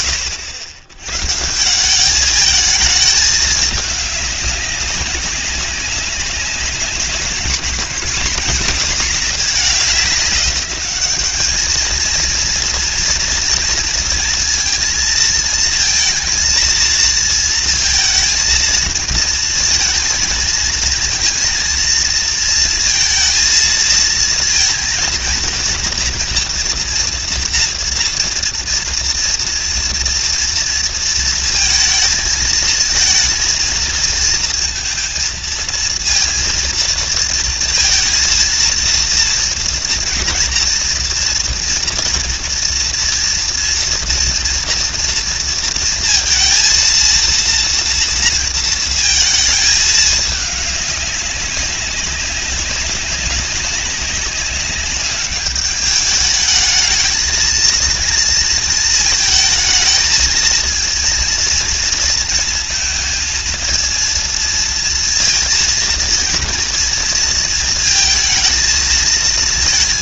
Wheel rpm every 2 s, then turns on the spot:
90, 220, 200, 190, 220, 200, 230, 230, 220, 220, 230, 230, 230, 230, 230, 230, 230, 230, 230, 230, 240, 230, 230, 230, 220, 200, 190, 200, 220, 230, 230, 230, 230, 230, 230.
none